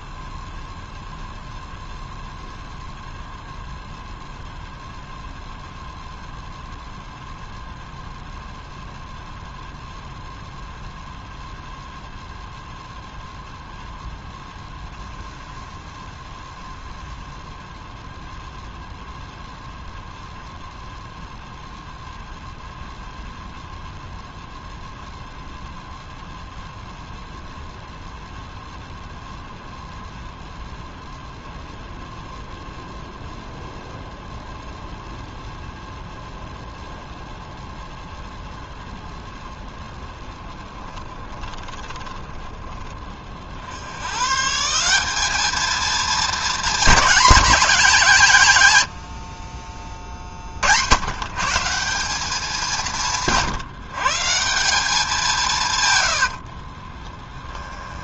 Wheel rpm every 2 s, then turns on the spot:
0, 0, 0, 0, 0, 0, 0, 0, 0, 0, 0, 0, 0, 0, 0, 0, 0, 0, 0, 0, 10, 10, 160, 230, 130, 80, 190, 190, 50.
40-42 56-58